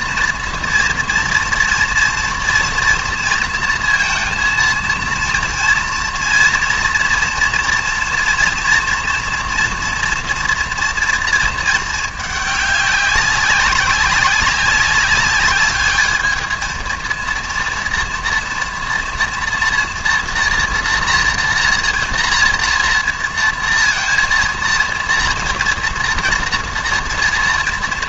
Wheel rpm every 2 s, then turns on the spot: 230, 230, 230, 230, 230, 230, 210, 200, 220, 230, 230, 230, 230, 230.
none